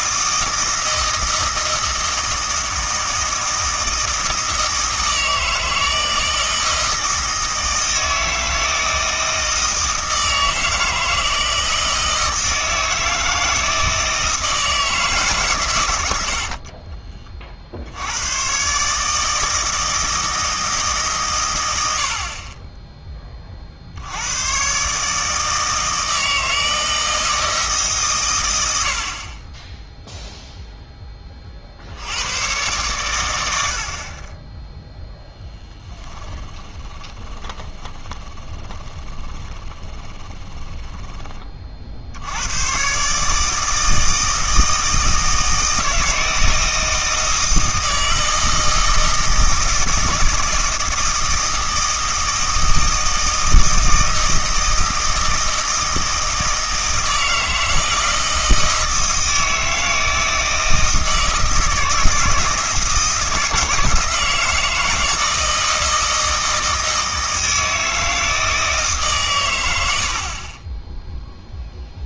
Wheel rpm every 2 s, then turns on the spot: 160, 160, 160, 160, 160, 160, 160, 160, 40, 130, 160, 20, 130, 160, 90, 0, 110, 10, 30, 30, 20, 120, 160, 160, 160, 160, 160, 160, 160, 160, 160, 160, 160, 160, 150, 10.
16-18 36-42